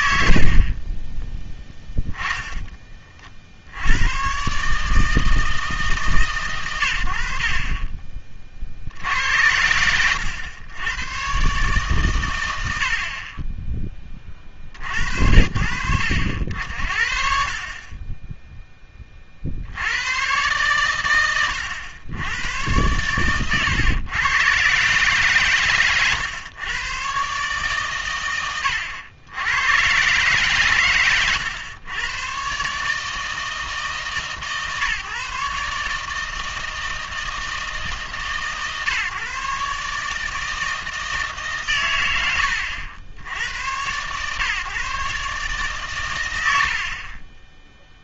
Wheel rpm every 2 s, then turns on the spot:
80, 20, 140, 110, 60, 100, 90, 50, 70, 10, 120, 110, 130, 110, 100, 120, 140, 150, 160, 140, 160, 100, 130, 80.
none